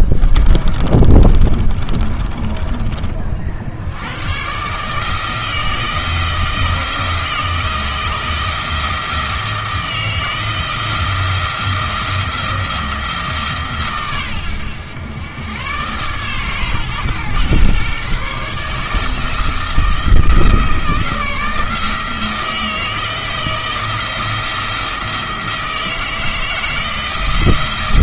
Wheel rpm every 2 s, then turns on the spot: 30, 20, 140, 170, 160, 170, 170, 100, 130, 150, 160, 160, 170, 160.
0-4